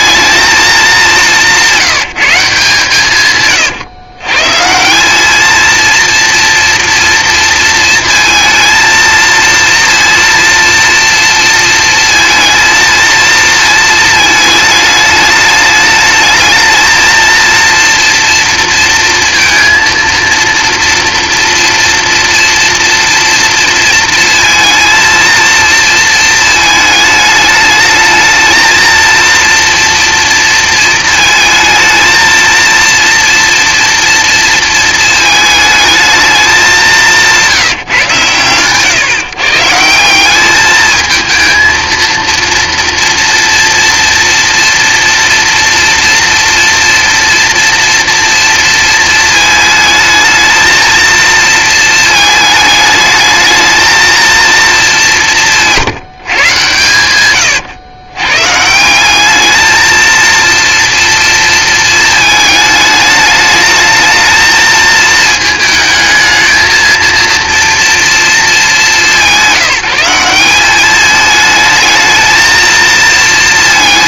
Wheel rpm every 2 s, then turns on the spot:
220, 170, 150, 230, 230, 230, 230, 220, 220, 230, 230, 230, 230, 220, 220, 230, 230, 230, 200, 130, 210, 230, 230, 230, 230, 220, 220, 230, 130, 140, 230, 210, 220, 220, 210, 190, 230.
none